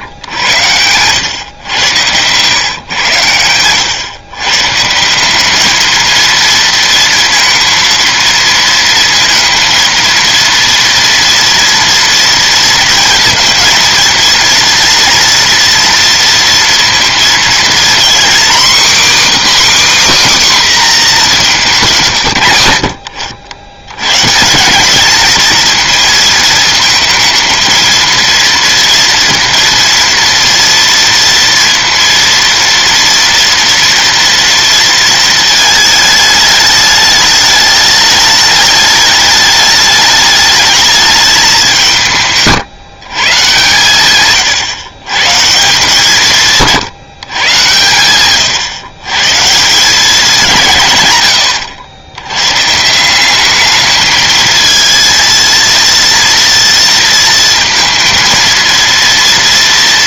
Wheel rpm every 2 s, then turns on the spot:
100, 120, 160, 230, 230, 230, 230, 230, 230, 270, 250, 70, 190, 220, 230, 230, 230, 230, 210, 210, 210, 150, 120, 150, 120, 140, 150, 220, 230, 230.
none